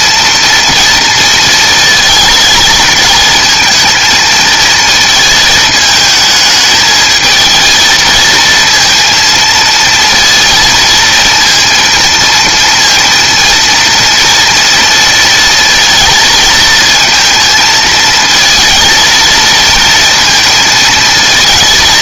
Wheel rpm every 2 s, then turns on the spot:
230, 220, 230, 220, 220, 230, 230, 230, 230, 230, 230.
none